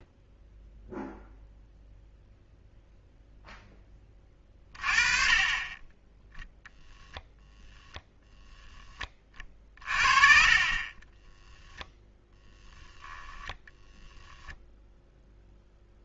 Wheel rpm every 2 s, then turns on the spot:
0, 0, 30, 0, 20, 30, 0, 0.
none